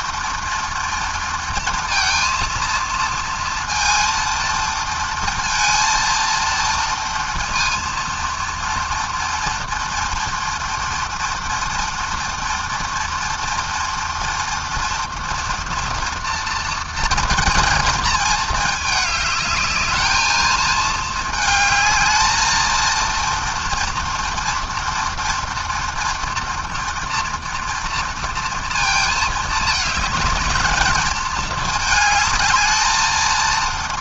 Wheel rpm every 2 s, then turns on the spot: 230, 230, 230, 230, 230, 230, 240, 230, 220, 210, 220, 230, 230, 230, 220, 220, 220.
none